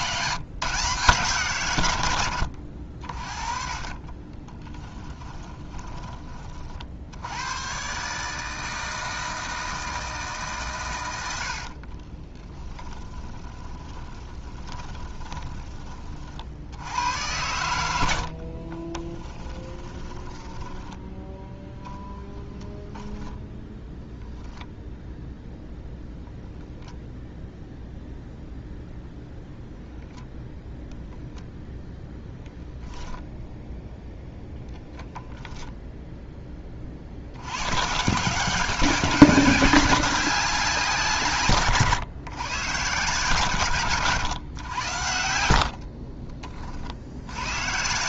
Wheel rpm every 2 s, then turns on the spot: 160, 70, 10, 60, 160, 130, 10, 20, 70, 20, 10, 0, 0, 0, 0, 0, 10, 0, 20, 190, 170, 130, 90, 50.
2-6 12-16 18-22